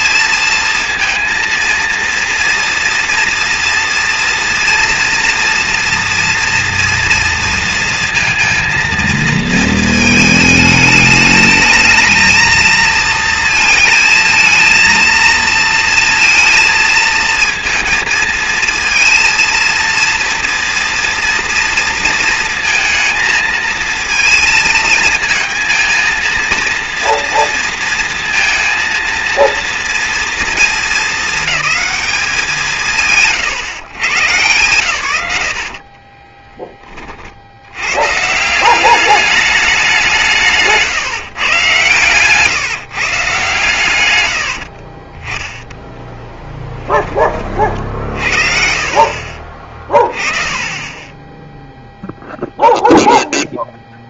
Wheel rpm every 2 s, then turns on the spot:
230, 230, 230, 230, 230, 220, 230, 230, 220, 220, 230, 220, 230, 230, 230, 220, 160, 150, 20, 180, 150, 150, 60, 10, 50, 20, 0.
44-46 50-52